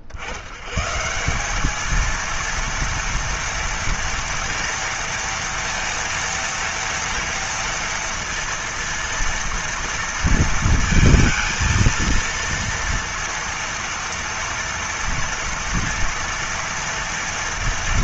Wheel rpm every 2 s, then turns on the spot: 50, 230, 230, 230, 230, 230, 230, 230, 230.
none